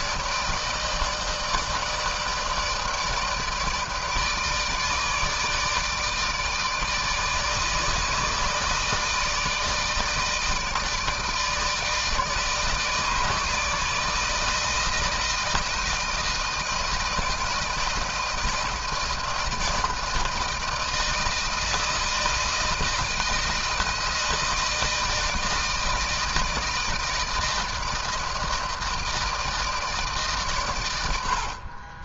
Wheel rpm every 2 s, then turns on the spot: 160, 160, 160, 160, 150, 160, 160, 160, 160, 160, 160, 160, 160, 160, 160, 120.
none